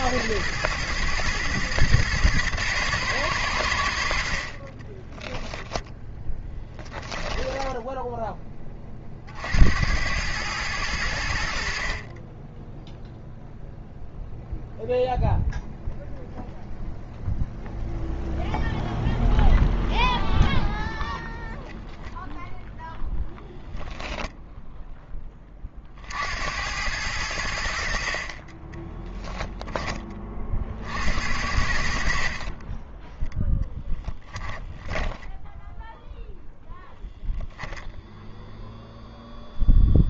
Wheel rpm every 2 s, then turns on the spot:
120, 110, 30, 10, 20, 110, 10, 0, 0, 0, 0, 0, 0, 90, 20, 50, 30, 10, 0, 0.
6-8 34-36